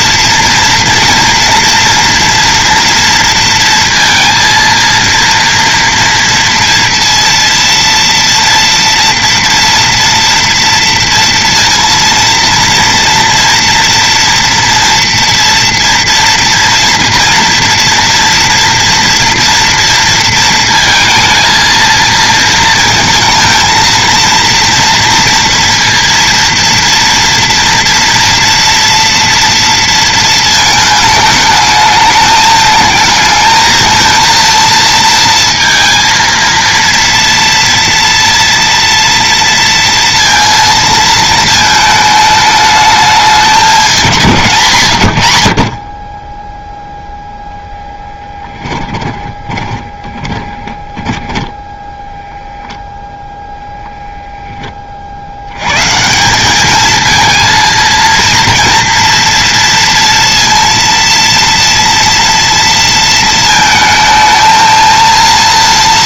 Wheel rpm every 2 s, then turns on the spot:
230, 230, 230, 230, 230, 230, 230, 230, 230, 230, 230, 230, 230, 230, 230, 220, 220, 230, 230, 230, 230, 210, 130, 0, 10, 20, 0, 20, 210, 230, 230, 230, 230.
48-52